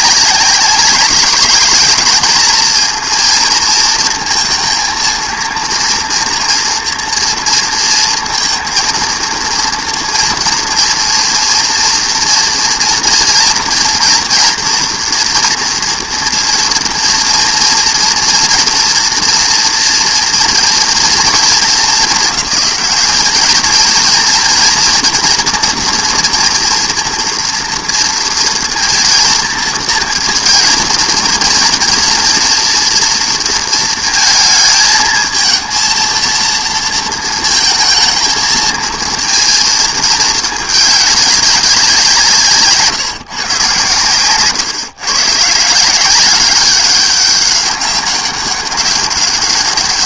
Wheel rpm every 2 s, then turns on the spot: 190, 220, 230, 230, 230, 230, 240, 230, 230, 230, 230, 210, 230, 230, 230, 230, 230, 220, 230, 230, 220, 160, 130, 190, 200.
none